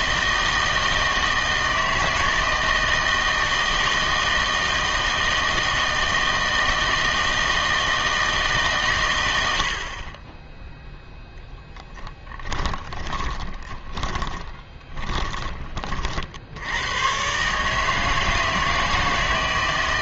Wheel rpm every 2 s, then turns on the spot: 160, 160, 160, 160, 140, 0, 20, 20, 80, 160.
12-16